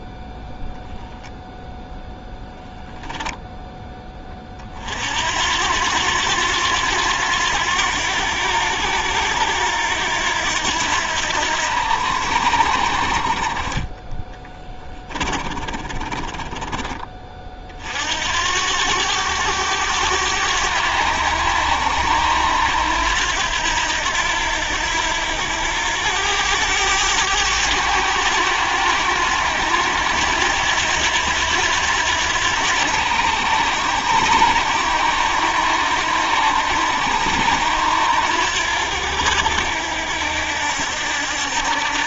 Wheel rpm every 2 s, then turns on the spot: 0, 0, 60, 90, 90, 80, 40, 20, 30, 100, 90, 90, 80, 100, 90, 90, 90, 90, 90, 80, 70.
14-16